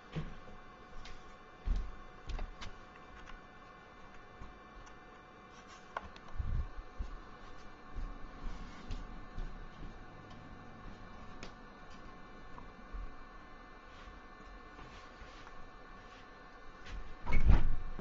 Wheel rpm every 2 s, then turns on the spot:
0, 0, 0, 0, 0, 0, 0, 0, 0.
none